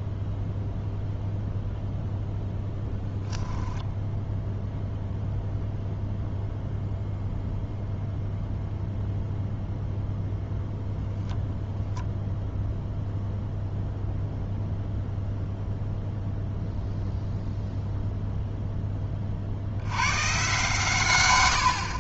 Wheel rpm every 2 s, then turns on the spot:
0, 0, 0, 0, 0, 0, 0, 0, 0, 10, 130.
none